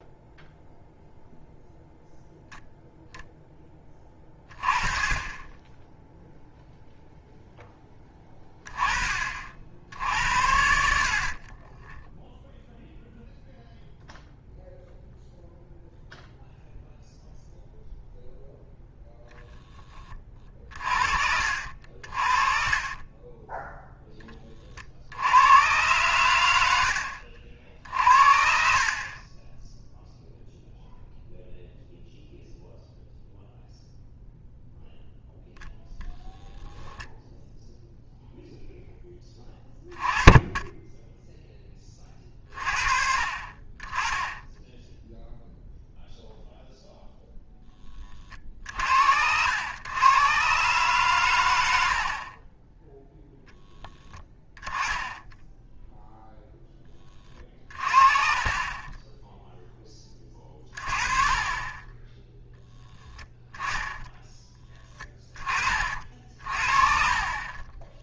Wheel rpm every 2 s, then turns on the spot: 0, 0, 20, 0, 20, 70, 0, 0, 0, 0, 40, 40, 20, 90, 60, 0, 0, 0, 0, 0, 20, 50, 20, 0, 50, 120, 20, 10, 0, 30, 20, 10, 10, 40.
22-24 52-54 58-62